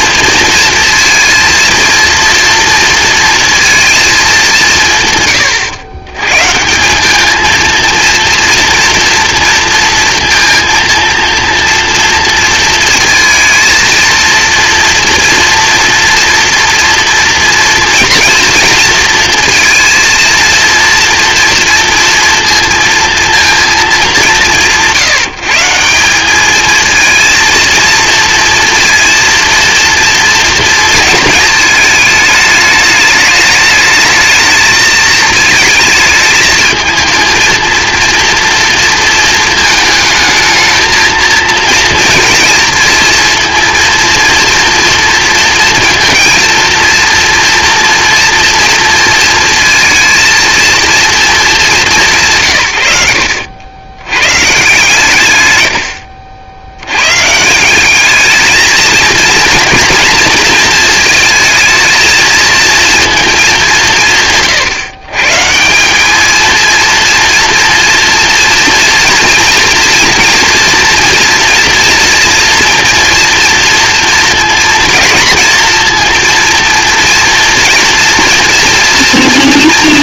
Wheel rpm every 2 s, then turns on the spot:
230, 230, 160, 180, 230, 230, 230, 230, 230, 230, 230, 230, 170, 230, 230, 230, 210, 220, 220, 230, 220, 230, 230, 230, 230, 230, 110, 140, 100, 220, 230, 230, 140, 230, 230, 240, 230, 230, 230, 240.
none